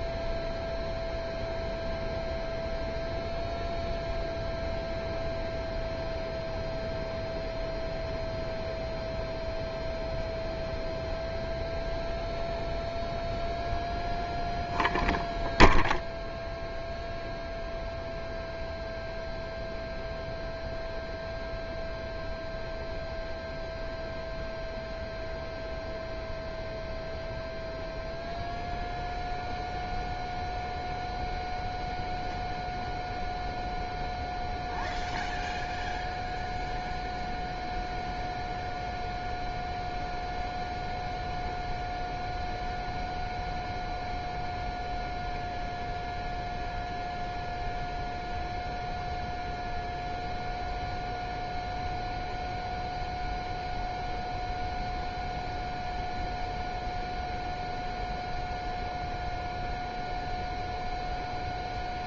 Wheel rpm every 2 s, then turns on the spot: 0, 0, 0, 0, 0, 0, 0, 0, 0, 0, 0, 0, 0, 0, 0, 0, 0, 0, 0, 0, 0, 0, 0, 0, 0, 0, 0, 0, 0, 0, 0.
none